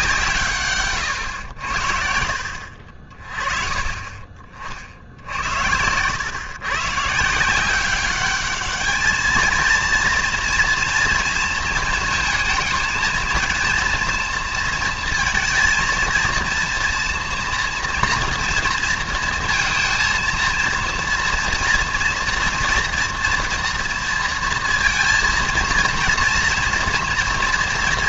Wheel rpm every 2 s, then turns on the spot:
140, 60, 50, 130, 210, 230, 220, 230, 240, 230, 230, 230, 230, 230.
none